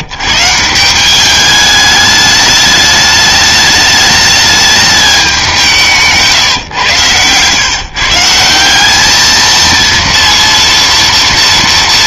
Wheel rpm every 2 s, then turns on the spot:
130, 210, 210, 150, 170, 230.
6-8